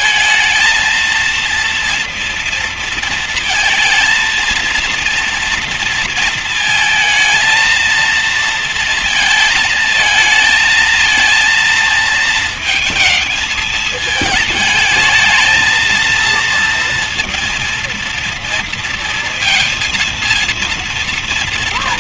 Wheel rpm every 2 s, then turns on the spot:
230, 230, 230, 230, 230, 220, 220, 210, 230, 230, 230.
none